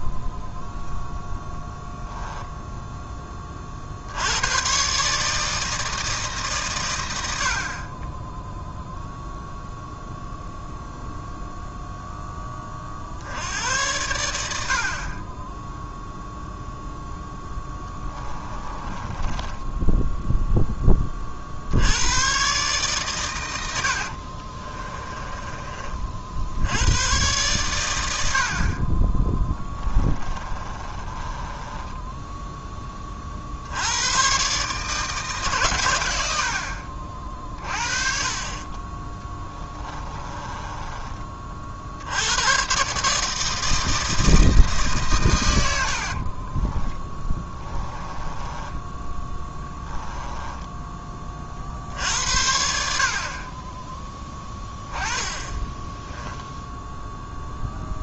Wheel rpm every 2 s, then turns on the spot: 0, 10, 140, 110, 0, 0, 50, 50, 0, 20, 20, 140, 30, 100, 40, 30, 20, 150, 40, 20, 20, 140, 140, 20, 10, 20, 50, 10, 0.
18-20 24-26 30-32 40-42 46-50